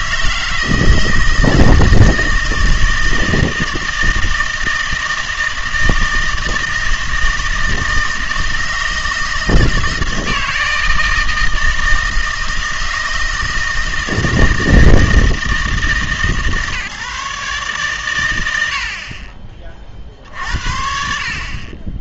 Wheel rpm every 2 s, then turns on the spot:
160, 160, 160, 160, 160, 160, 160, 160, 140, 80, 60.
none